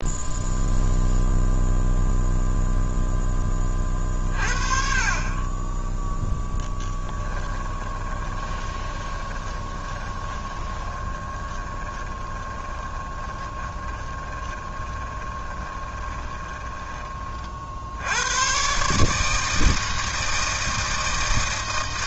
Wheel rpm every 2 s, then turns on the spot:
0, 0, 40, 10, 20, 20, 20, 20, 20, 140, 160.
8-16